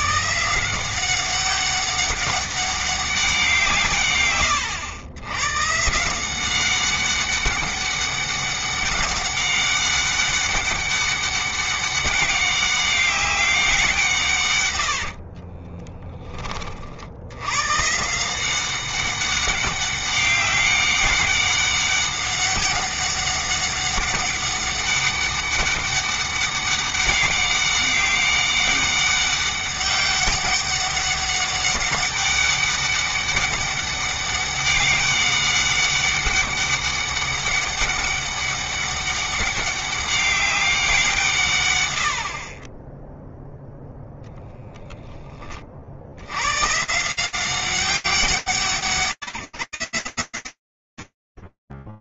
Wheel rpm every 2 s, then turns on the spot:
180, 190, 100, 200, 200, 200, 190, 70, 70, 190, 200, 200, 200, 200, 200, 200, 200, 200, 200, 200, 160, 10, 20, 170, 170, 80.
14-16